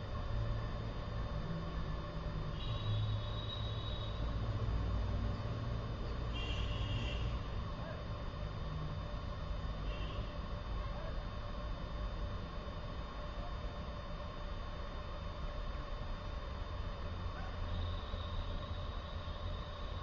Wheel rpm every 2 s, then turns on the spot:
0, 0, 0, 0, 0, 0, 0, 0, 0, 0.
none